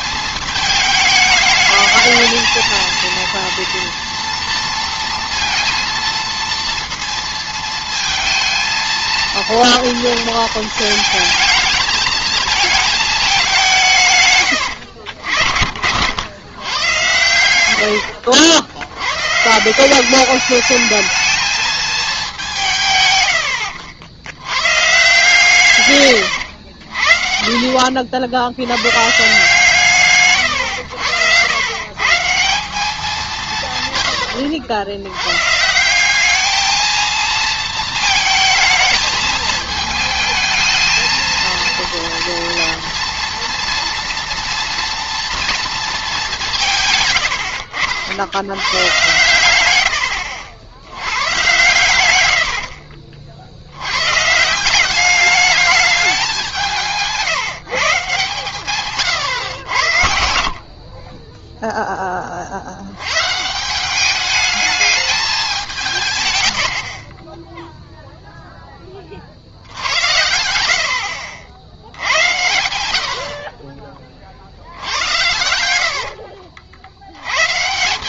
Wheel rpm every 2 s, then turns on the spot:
220, 220, 230, 230, 230, 220, 220, 110, 120, 80, 210, 150, 120, 90, 100, 110, 180, 80, 210, 220, 220, 230, 230, 170, 100, 100, 60, 170, 180, 130, 50, 60, 210, 80, 0, 70, 80, 70, 70.
none